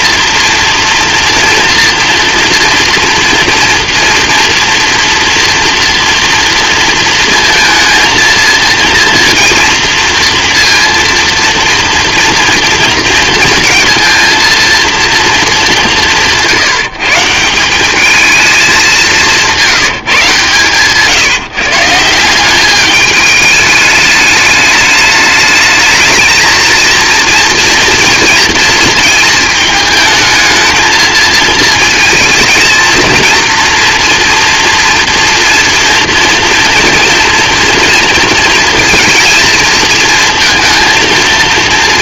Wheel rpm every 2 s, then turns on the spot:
230, 230, 240, 230, 230, 230, 230, 230, 170, 210, 140, 200, 210, 220, 230, 220, 230, 230, 230, 230, 230.
none